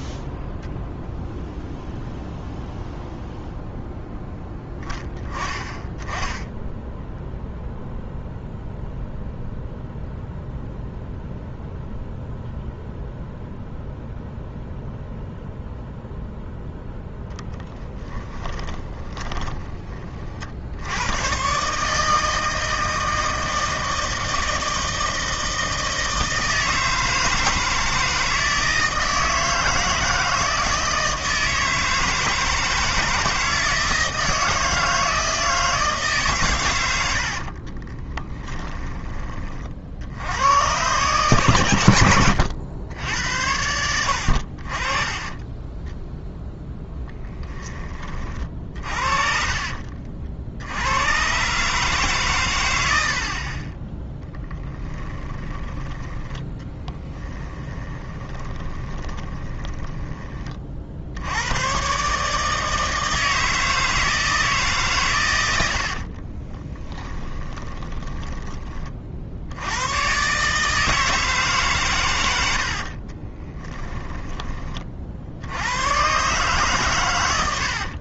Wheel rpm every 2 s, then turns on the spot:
0, 0, 10, 10, 0, 0, 0, 0, 10, 20, 80, 160, 160, 160, 160, 160, 160, 160, 100, 20, 120, 80, 40, 0, 40, 80, 100, 10, 10, 20, 50, 150, 140, 20, 30, 150, 70, 30, 130.
18-20 48-50 54-60 66-68 72-74